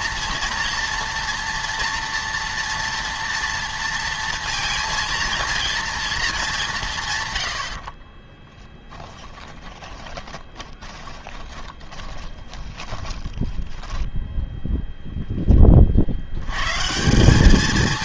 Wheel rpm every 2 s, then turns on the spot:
230, 240, 230, 190, 10, 20, 10, 0, 120.
8-14